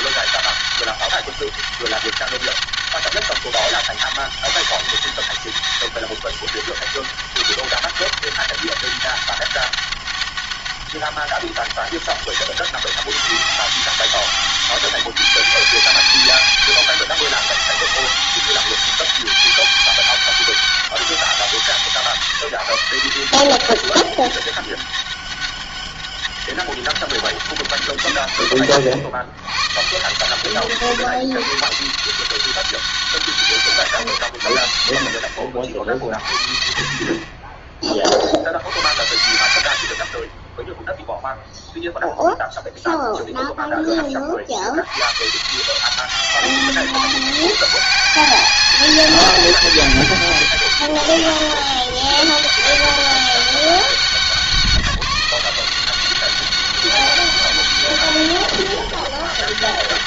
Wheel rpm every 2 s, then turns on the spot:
200, 200, 200, 200, 200, 200, 190, 200, 200, 200, 200, 160, 200, 190, 100, 110, 180, 110, 50, 70, 30, 0, 50, 180, 190, 200, 200, 180, 190, 200.
none